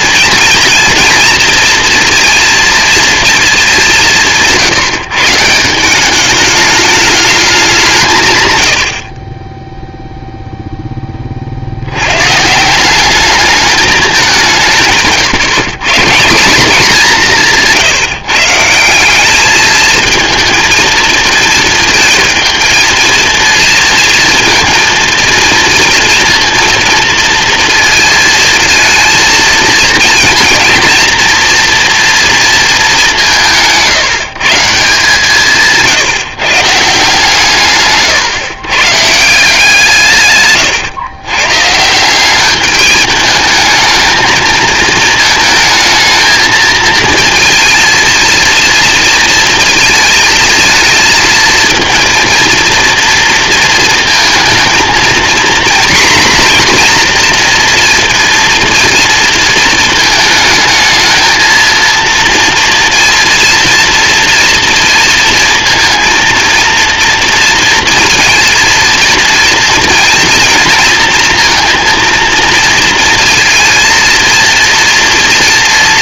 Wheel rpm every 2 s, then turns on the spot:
230, 230, 160, 210, 100, 0, 160, 170, 200, 170, 220, 230, 230, 230, 230, 230, 220, 160, 150, 130, 120, 210, 220, 220, 230, 230, 230, 220, 240, 230, 220, 230, 230, 230, 230, 230, 230, 230.
none